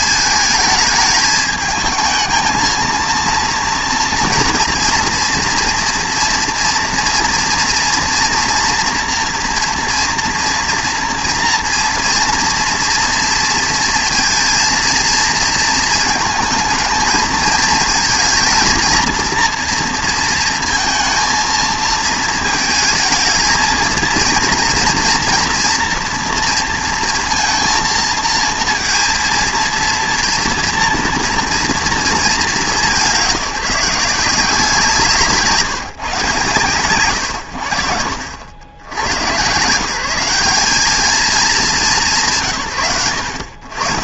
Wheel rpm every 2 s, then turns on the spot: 220, 220, 230, 230, 240, 230, 230, 230, 220, 230, 220, 220, 230, 230, 230, 230, 190, 170, 120, 80, 200, 80.
none